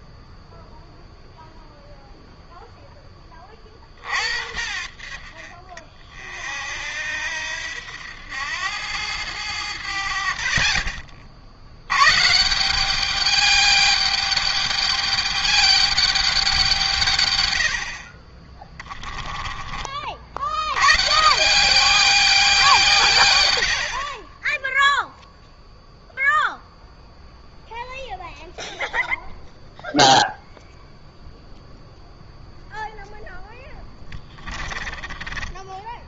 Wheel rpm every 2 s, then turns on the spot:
0, 0, 60, 60, 100, 50, 170, 210, 170, 20, 70, 170, 10, 0, 0, 0, 0, 30.
18-20 34-36